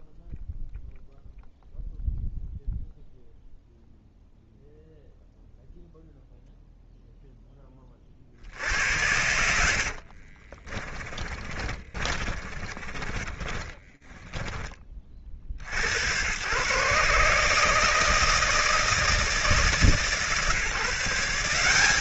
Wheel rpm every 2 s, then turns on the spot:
0, 0, 0, 0, 90, 30, 30, 40, 140, 150, 170.
10-14